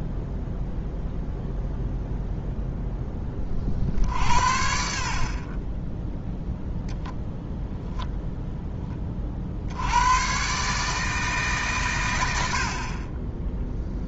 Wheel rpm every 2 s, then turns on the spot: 0, 0, 60, 0, 10, 150, 50.
none